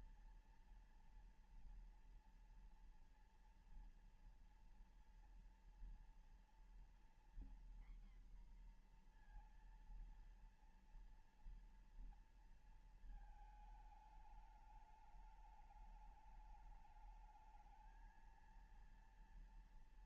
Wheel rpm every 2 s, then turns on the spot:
230, 230, 230, 230, 240, 230, 230, 210, 210, 230.
none